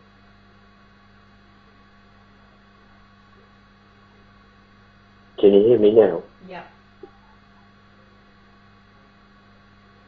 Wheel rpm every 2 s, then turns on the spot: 0, 0, 0, 0, 0.
none